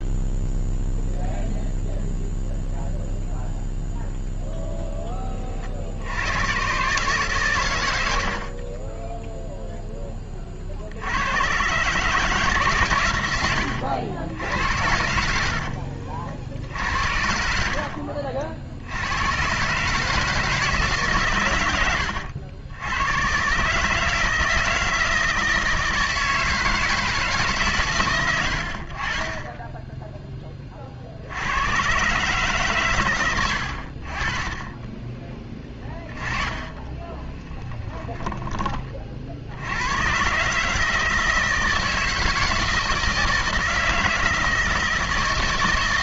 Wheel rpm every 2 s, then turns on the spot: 0, 0, 0, 120, 30, 40, 140, 90, 60, 70, 160, 100, 160, 160, 80, 30, 130, 20, 10, 20, 140, 170, 160.
8-10 14-16 36-38